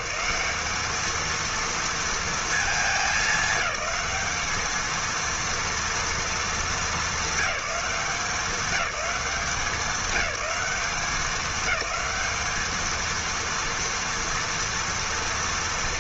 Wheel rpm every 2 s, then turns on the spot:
200, 220, 210, 210, 200, 190, 220, 230.
none